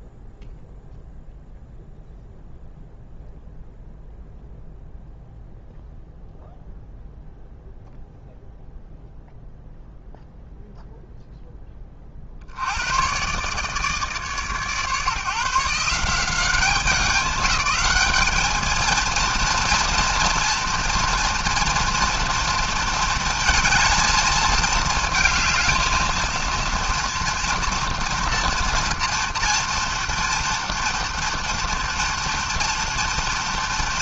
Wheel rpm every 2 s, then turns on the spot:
0, 0, 0, 0, 0, 0, 70, 140, 190, 220, 230, 230, 220, 230, 230, 240, 230.
none